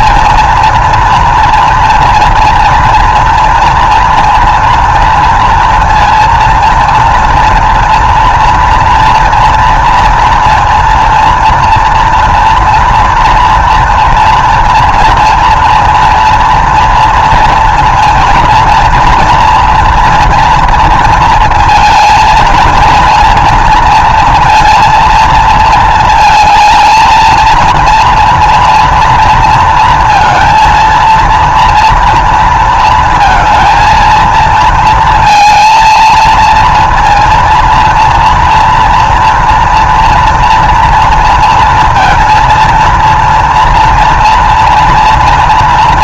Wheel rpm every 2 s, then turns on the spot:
230, 230, 230, 240, 230, 230, 230, 240, 230, 230, 230, 230, 230, 220, 230, 230, 230, 230, 230, 240, 230, 230, 230.
none